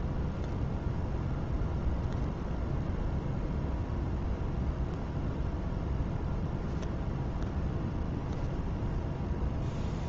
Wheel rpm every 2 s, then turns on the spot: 0, 0, 0, 0, 0.
none